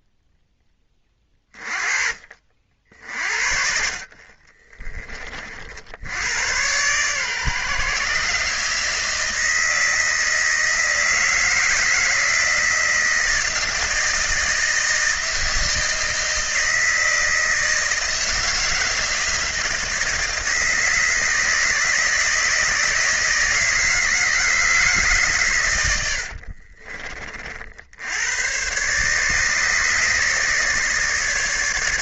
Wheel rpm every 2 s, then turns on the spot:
0, 30, 40, 70, 140, 160, 160, 160, 160, 160, 160, 160, 160, 110, 70, 150.
none